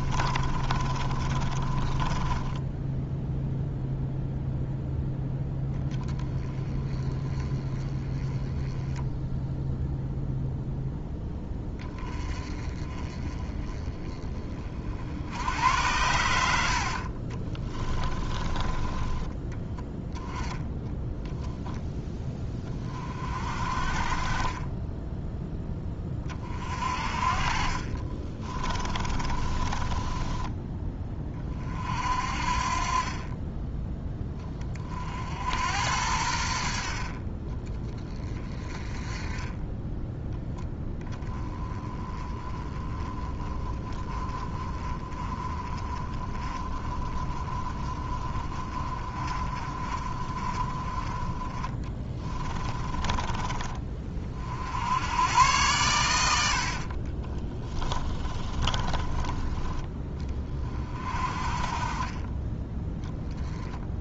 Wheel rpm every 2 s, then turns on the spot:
30, 10, 0, 20, 10, 0, 30, 50, 60, 20, 10, 30, 10, 40, 30, 20, 30, 40, 50, 20, 10, 20, 20, 30, 30, 20, 30, 80, 50, 20, 40, 10.
0-2 16-20 24-26 28-30 52-54 56-60